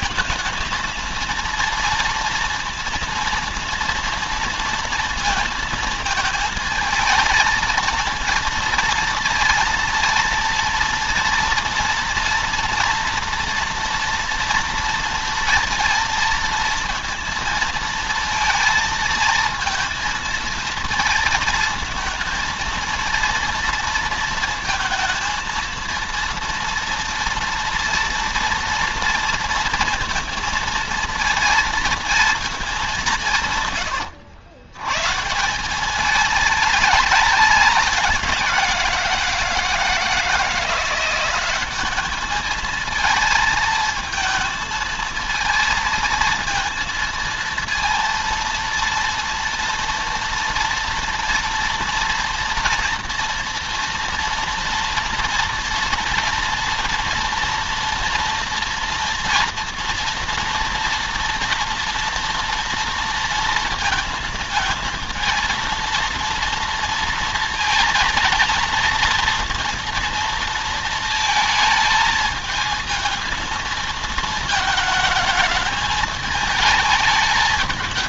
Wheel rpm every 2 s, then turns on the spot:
220, 230, 230, 220, 230, 230, 230, 230, 230, 230, 220, 220, 220, 230, 230, 230, 200, 120, 210, 180, 170, 220, 220, 230, 230, 230, 240, 230, 230, 230, 230, 230, 230, 230, 220, 230, 220, 220, 220.
none